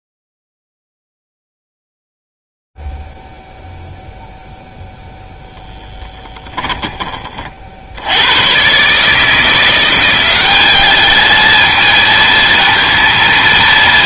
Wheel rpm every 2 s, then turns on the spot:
0, 0, 0, 10, 80, 180, 230.
6-8